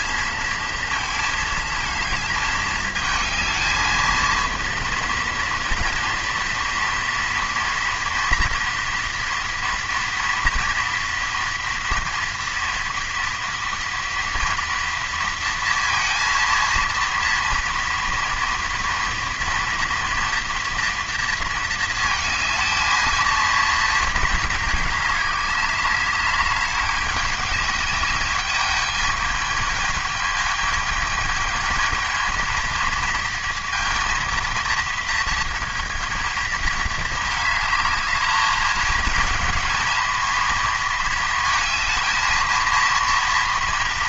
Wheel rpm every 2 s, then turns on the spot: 220, 220, 230, 230, 230, 230, 230, 230, 230, 230, 230, 220, 220, 200, 200, 210, 220, 230, 220, 220, 230, 230.
none